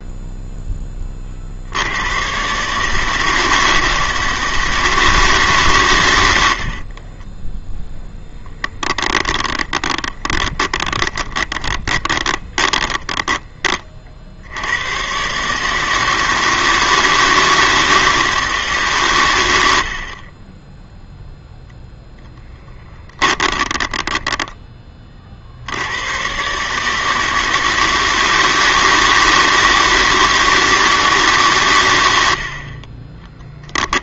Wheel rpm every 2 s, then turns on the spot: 20, 150, 160, 40, 10, 20, 10, 110, 160, 130, 0, 20, 30, 150, 160, 160, 30.
6-14 22-24 32-34